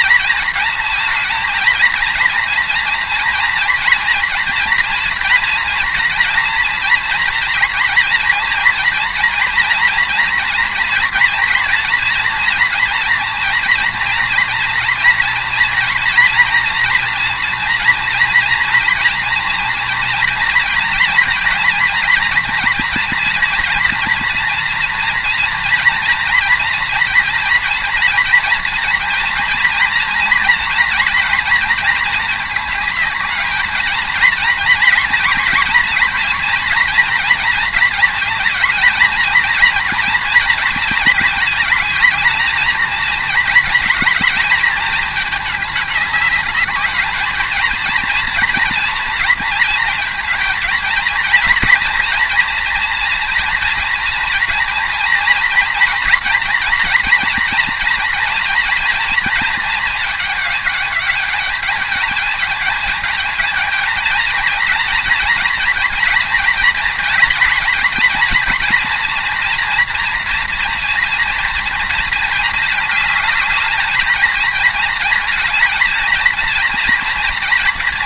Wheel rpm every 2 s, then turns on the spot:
230, 230, 240, 230, 230, 230, 240, 230, 230, 240, 230, 230, 230, 240, 230, 230, 220, 230, 230, 220, 230, 220, 210, 210, 230, 230, 240, 230, 240, 230, 210, 220, 230, 230, 230, 230, 220, 220, 230.
none